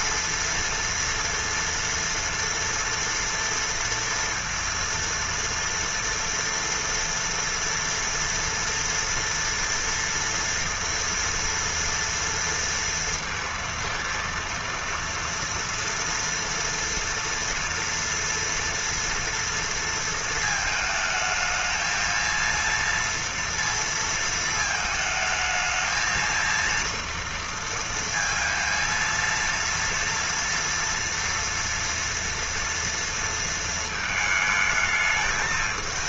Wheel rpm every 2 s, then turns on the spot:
230, 230, 230, 230, 230, 230, 230, 230, 230, 230, 220, 230, 220, 230, 230, 230, 230, 220.
none